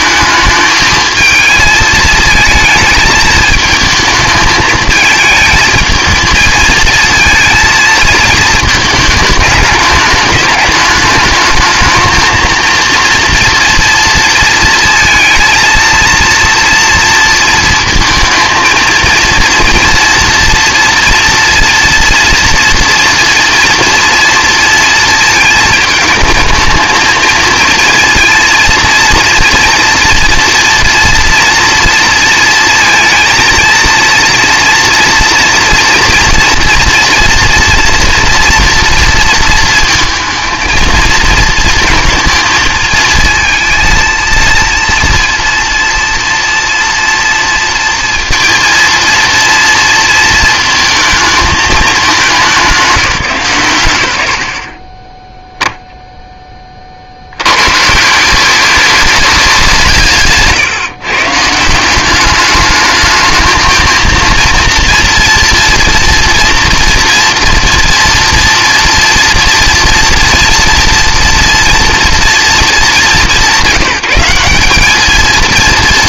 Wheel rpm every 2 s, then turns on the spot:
220, 220, 210, 220, 220, 210, 230, 230, 230, 220, 230, 230, 230, 220, 230, 230, 230, 230, 230, 230, 220, 220, 230, 230, 230, 230, 180, 30, 30, 200, 140, 210, 230, 240, 240, 240, 200, 200.
none